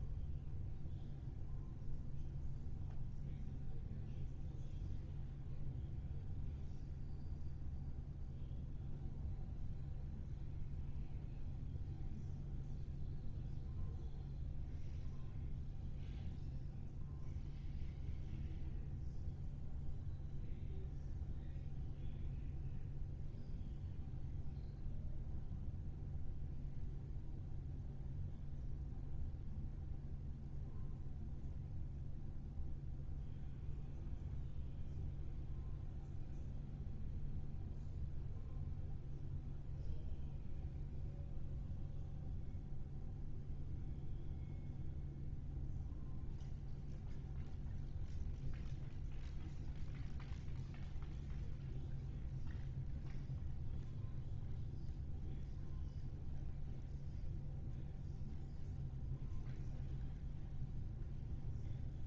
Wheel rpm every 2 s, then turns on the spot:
0, 0, 0, 0, 0, 0, 0, 0, 0, 0, 0, 0, 0, 0, 0, 0, 0, 0, 0, 0, 0, 0, 0, 0, 0, 0, 0, 0, 0, 0, 0.
none